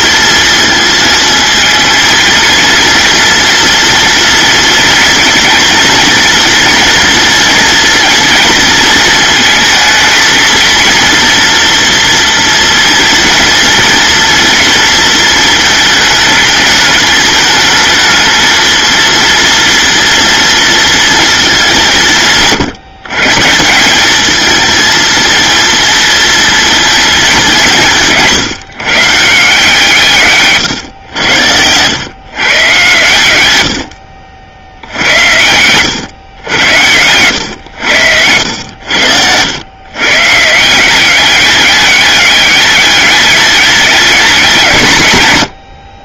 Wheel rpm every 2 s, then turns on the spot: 230, 230, 230, 230, 230, 230, 230, 230, 210, 220, 230, 160, 230, 230, 150, 130, 120, 70, 100, 90, 170, 210, 170.
none